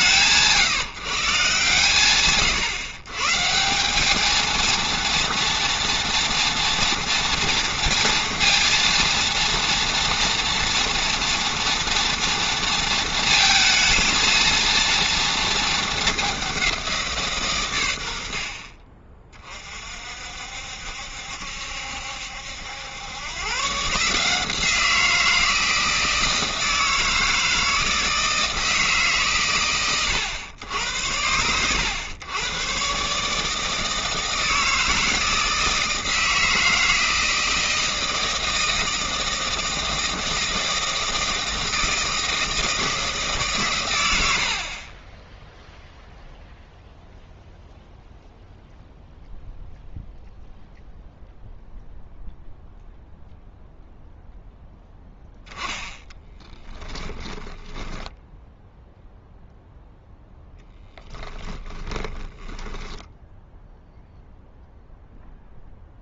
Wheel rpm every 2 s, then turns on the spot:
160, 130, 230, 240, 230, 240, 230, 230, 180, 40, 60, 90, 170, 160, 160, 100, 120, 160, 160, 160, 160, 170, 40, 0, 0, 0, 0, 0, 10, 0, 10, 10, 0.
56-58 60-64